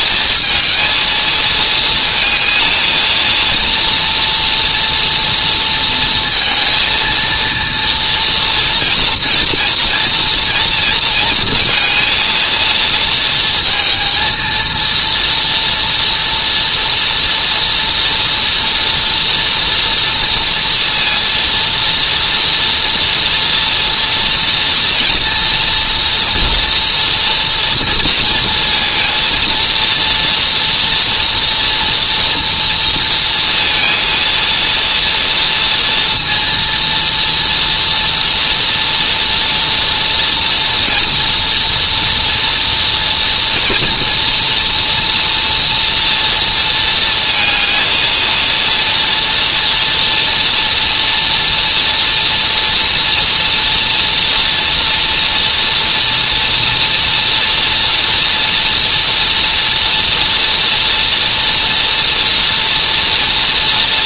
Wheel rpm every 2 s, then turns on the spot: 220, 220, 230, 230, 240, 240, 230, 240, 240, 230, 230, 240, 230, 230, 230, 240, 240, 230, 230, 230, 240, 230, 230, 230, 230, 230, 230, 230, 230, 230, 230, 230.
none